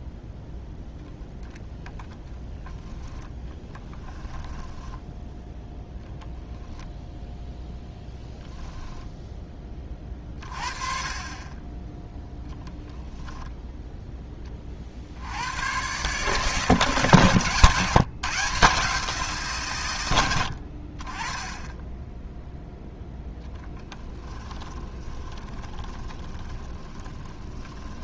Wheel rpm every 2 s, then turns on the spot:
0, 0, 10, 0, 10, 30, 0, 50, 150, 160, 60, 10, 20, 20.
4-6 22-28